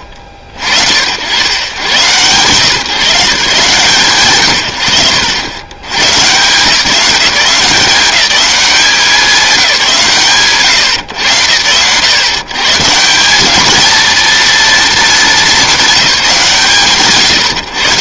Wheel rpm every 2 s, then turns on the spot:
50, 150, 120, 170, 200, 130, 150, 230, 140.
none